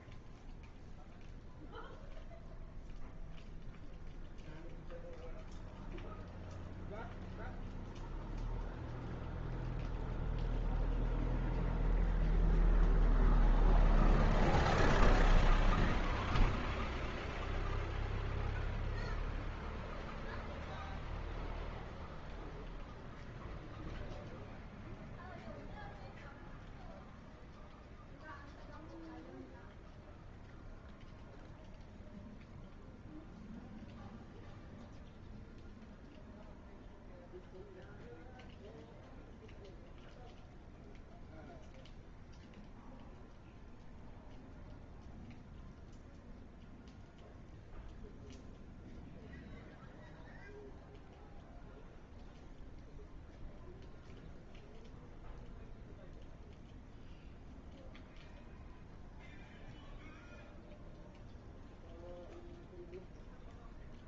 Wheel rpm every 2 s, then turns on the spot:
0, 0, 0, 0, 0, 0, 0, 0, 0, 0, 0, 0, 0, 0, 0, 0, 0, 0, 0, 0, 0, 0, 0, 0, 0, 0, 0, 0, 0, 0, 0, 0.
none